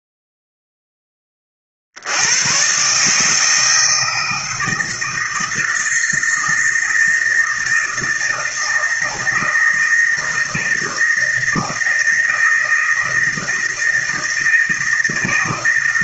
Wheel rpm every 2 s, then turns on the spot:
0, 130, 160, 160, 160, 160, 160, 160.
none